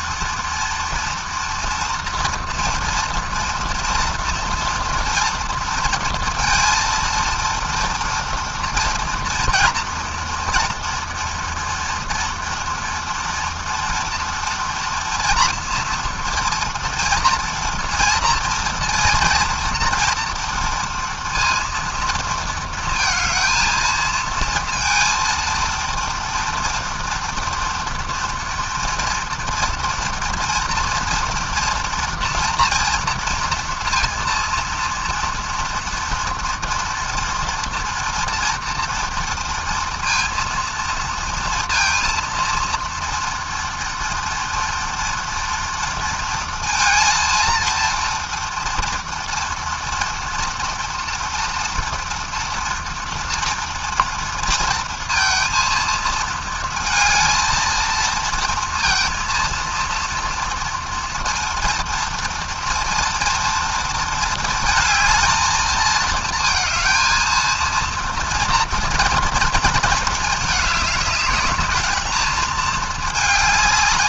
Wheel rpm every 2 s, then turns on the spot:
230, 230, 240, 230, 230, 230, 230, 230, 230, 230, 230, 220, 230, 230, 230, 230, 230, 230, 240, 230, 230, 230, 230, 230, 230, 230, 230, 230, 220, 230, 230, 230, 220, 230, 230, 210, 220.
none